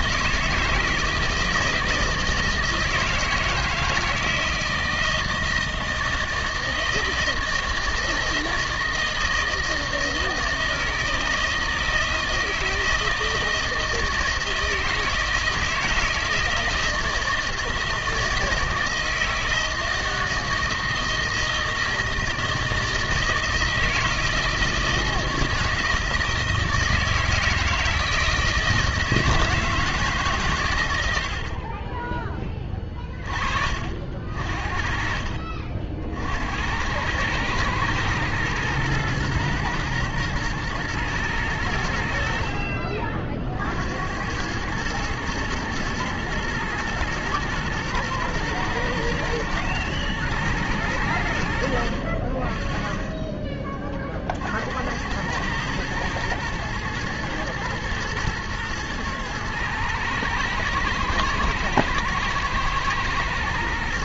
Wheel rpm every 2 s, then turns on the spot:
160, 160, 160, 160, 160, 160, 160, 160, 160, 160, 160, 160, 160, 160, 160, 120, 20, 50, 80, 110, 110, 50, 100, 120, 110, 110, 30, 60, 110, 110, 110, 110.
none